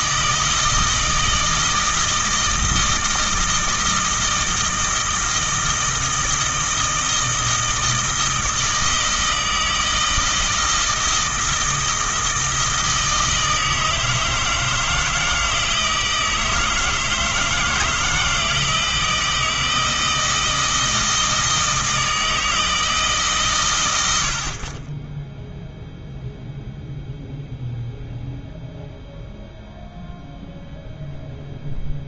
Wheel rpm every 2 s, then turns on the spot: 160, 160, 160, 160, 160, 160, 160, 160, 160, 160, 160, 160, 30, 0, 0, 0.
none